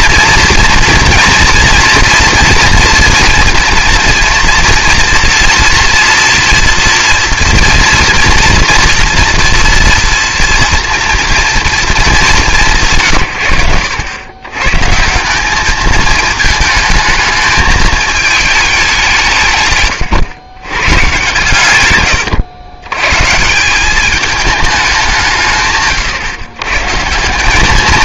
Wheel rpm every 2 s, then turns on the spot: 230, 230, 230, 230, 230, 240, 180, 120, 220, 210, 120, 110, 210, 130.
none